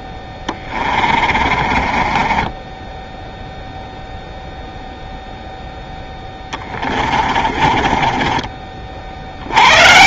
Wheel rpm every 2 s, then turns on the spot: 20, 20, 0, 20, 30.
0-4 6-8